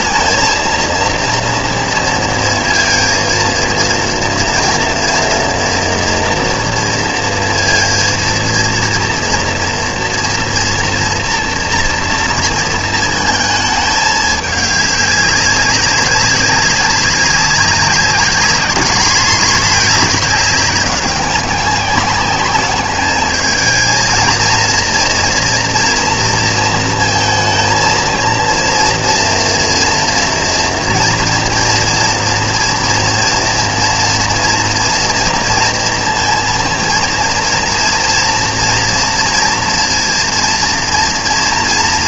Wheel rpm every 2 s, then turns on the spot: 230, 230, 230, 230, 230, 230, 230, 210, 200, 210, 200, 200, 230, 230, 230, 230, 230, 230, 240, 230, 230.
none